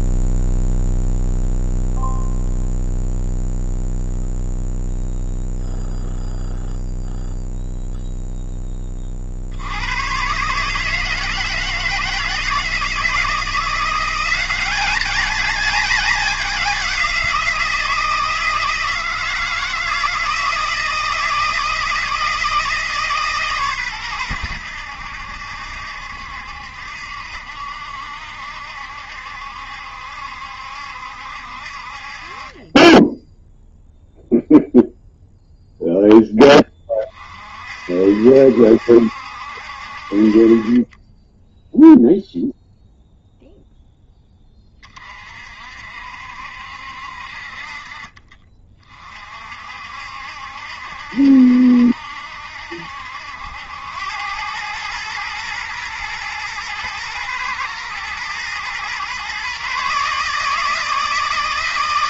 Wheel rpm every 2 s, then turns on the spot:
0, 0, 0, 0, 10, 140, 160, 200, 200, 160, 160, 160, 100, 70, 70, 70, 30, 0, 20, 70, 30, 0, 20, 60, 30, 70, 70, 110, 110, 120, 160.
none